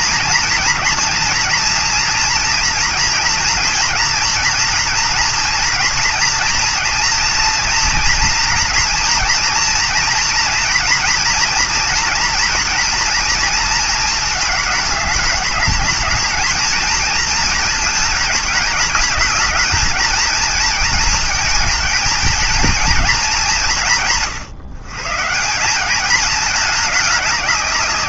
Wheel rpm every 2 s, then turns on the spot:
240, 230, 230, 230, 230, 230, 230, 210, 220, 220, 220, 220, 150, 210.
none